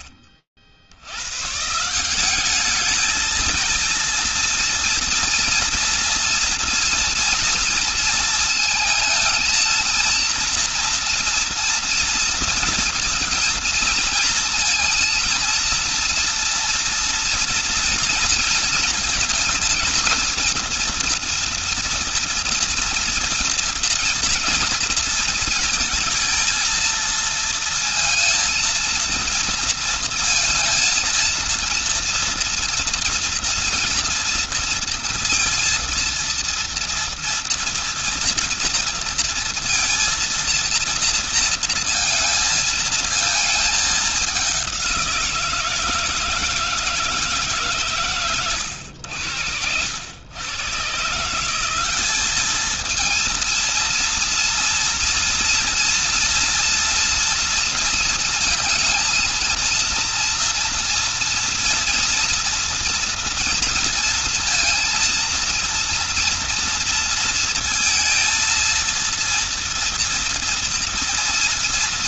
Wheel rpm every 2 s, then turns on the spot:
60, 210, 230, 230, 220, 230, 230, 230, 230, 230, 230, 240, 230, 220, 230, 230, 230, 230, 230, 230, 230, 230, 190, 160, 110, 130, 220, 230, 240, 230, 230, 230, 230, 230, 230, 230.
none